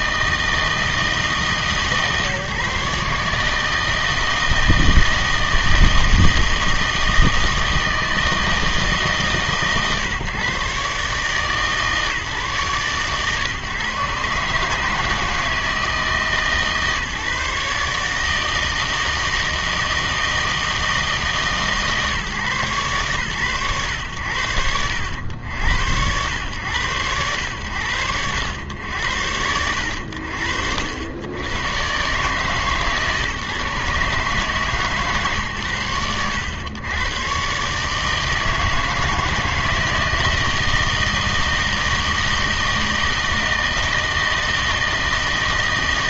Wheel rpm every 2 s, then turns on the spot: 160, 150, 160, 160, 150, 130, 140, 150, 150, 160, 160, 120, 90, 110, 100, 80, 140, 140, 110, 160, 160, 160, 160.
none